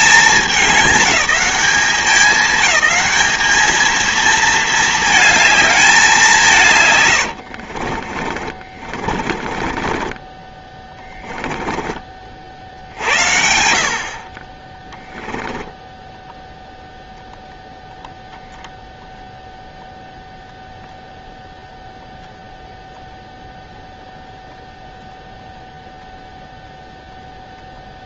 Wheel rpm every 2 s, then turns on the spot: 210, 190, 220, 190, 40, 30, 50, 30, 0, 0, 0, 0, 0, 0.
8-12